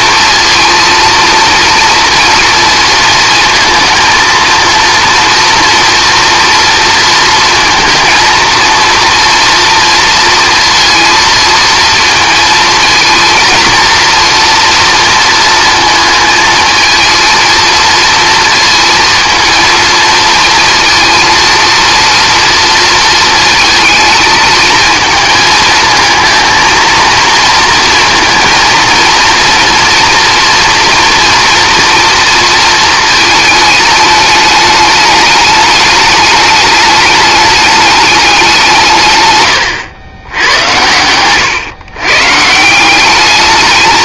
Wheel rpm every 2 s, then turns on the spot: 230, 230, 230, 230, 230, 230, 230, 230, 220, 230, 230, 230, 220, 230, 230, 240, 220, 210, 210, 150, 100, 190.
none